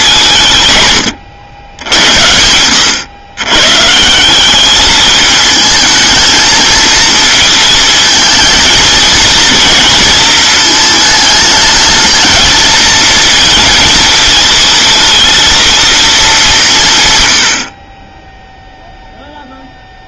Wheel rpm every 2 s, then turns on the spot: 130, 90, 200, 230, 230, 220, 220, 220, 170, 0.
none